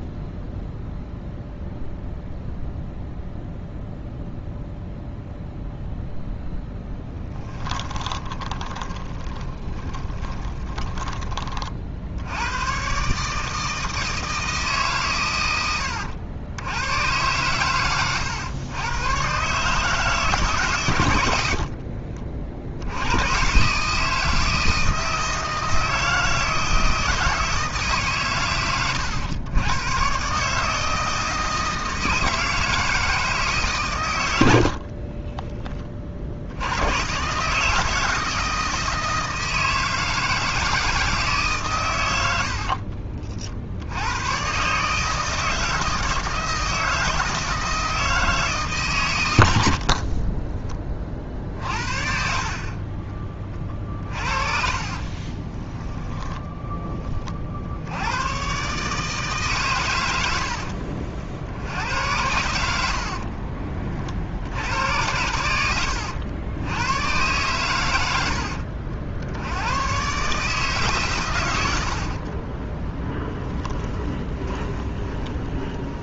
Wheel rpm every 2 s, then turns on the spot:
0, 0, 0, 10, 20, 20, 130, 130, 100, 120, 110, 90, 160, 160, 100, 160, 160, 40, 110, 160, 160, 50, 150, 160, 140, 30, 30, 30, 20, 140, 50, 70, 100, 110, 70, 130, 20, 20.
8-12 34-36 42-44 52-56 62-64 72-76